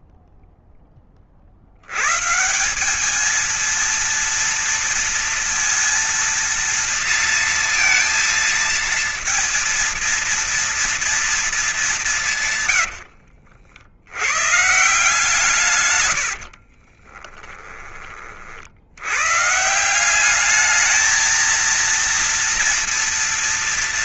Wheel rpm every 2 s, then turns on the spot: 0, 150, 230, 230, 230, 230, 160, 100, 60, 50, 200, 230.
12-14 16-18